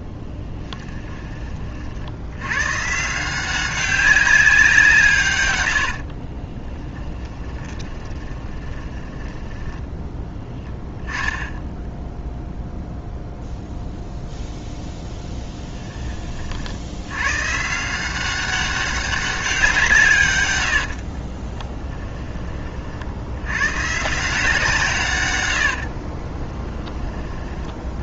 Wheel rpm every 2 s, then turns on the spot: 10, 140, 160, 10, 20, 0, 0, 0, 80, 200, 70, 50, 150, 30.
6-10 20-22 26-28